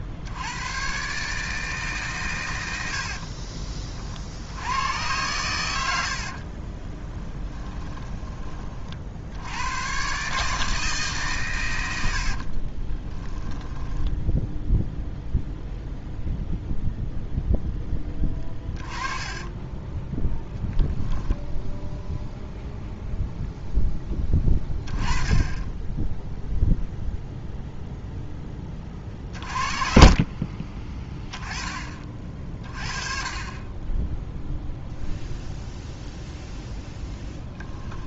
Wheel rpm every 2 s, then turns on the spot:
100, 100, 90, 30, 40, 150, 30, 0, 0, 20, 0, 0, 10, 0, 20, 30, 40, 0, 0.
2-4 6-8 12-14 18-20